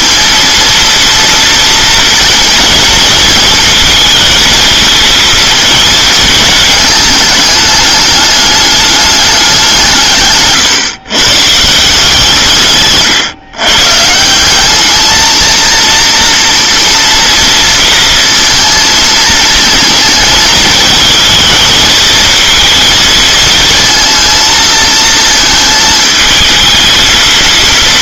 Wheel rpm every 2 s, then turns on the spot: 230, 230, 230, 210, 210, 130, 140, 210, 230, 230, 220, 220, 230, 220.
none